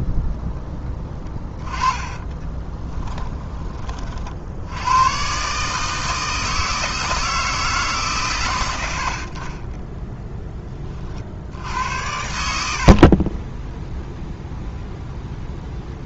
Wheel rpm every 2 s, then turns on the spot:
10, 10, 90, 160, 80, 30, 60, 0.
2-4